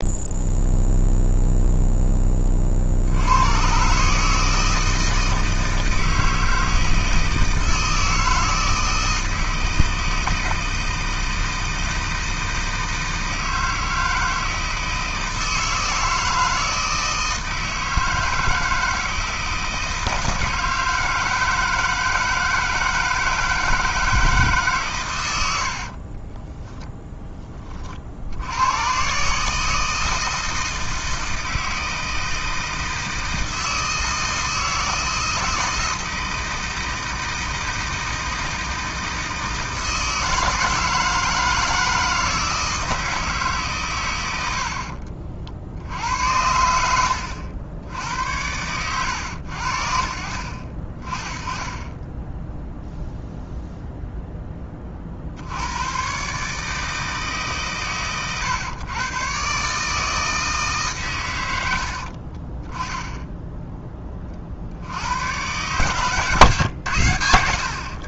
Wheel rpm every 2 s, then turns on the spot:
0, 50, 160, 160, 160, 160, 160, 160, 160, 160, 160, 160, 140, 0, 110, 160, 160, 160, 160, 160, 160, 160, 70, 80, 100, 50, 0, 20, 150, 120, 150, 20, 50, 130.
44-46